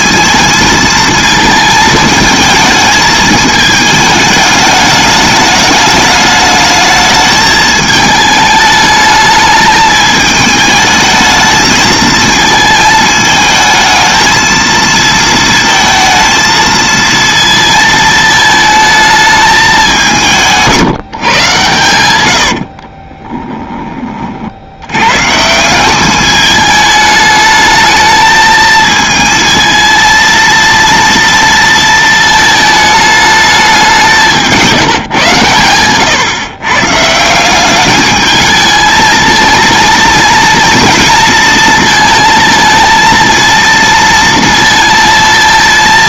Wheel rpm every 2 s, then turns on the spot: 220, 220, 210, 220, 210, 220, 220, 220, 220, 220, 160, 60, 90, 210, 220, 230, 220, 170, 140, 220, 230, 220, 230.
22-24